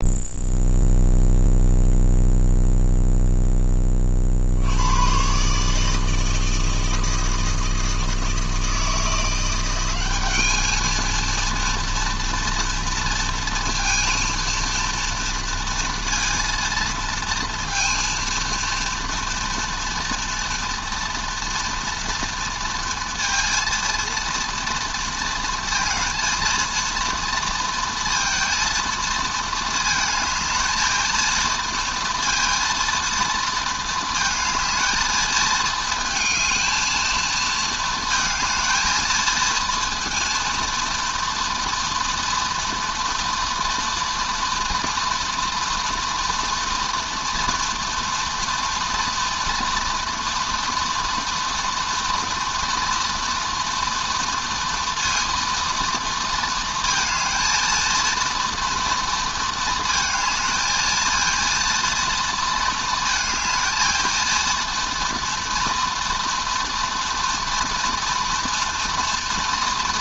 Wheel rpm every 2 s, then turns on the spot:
0, 0, 80, 160, 160, 220, 230, 230, 230, 230, 230, 230, 230, 230, 230, 220, 230, 230, 220, 220, 230, 230, 230, 230, 230, 230, 230, 230, 230, 230, 230, 230, 230, 230, 230.
none